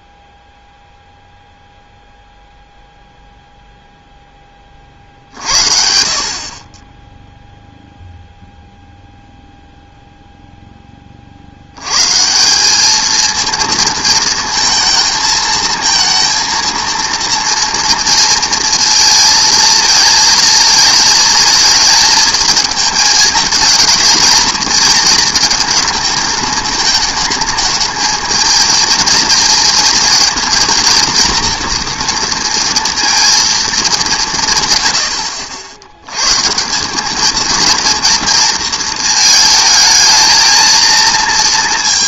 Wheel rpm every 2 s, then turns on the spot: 0, 0, 10, 30, 0, 0, 190, 220, 230, 230, 220, 220, 220, 220, 230, 230, 230, 120, 150, 230, 220.
none